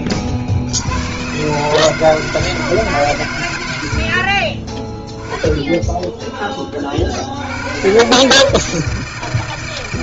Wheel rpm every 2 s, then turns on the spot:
70, 160, 10, 50, 160.
none